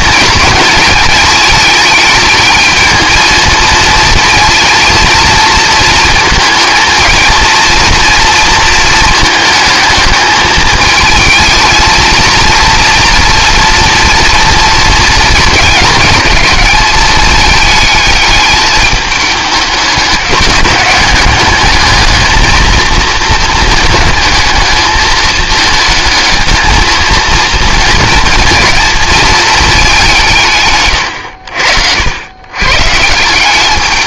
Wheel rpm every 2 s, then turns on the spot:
220, 220, 230, 230, 230, 220, 230, 230, 210, 210, 200, 220, 220, 220, 230, 130, 130.
none